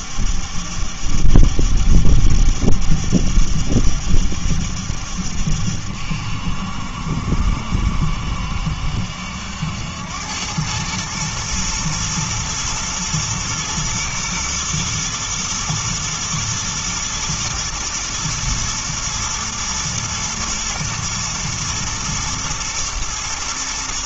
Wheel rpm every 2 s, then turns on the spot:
70, 70, 70, 70, 70, 100, 120, 120, 120, 120, 110, 110.
none